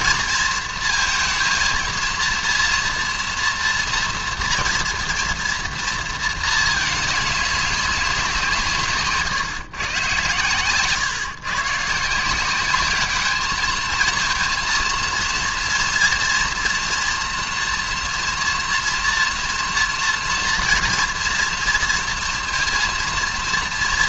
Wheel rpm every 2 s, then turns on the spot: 230, 230, 230, 220, 170, 130, 190, 230, 230, 230, 230, 230.
none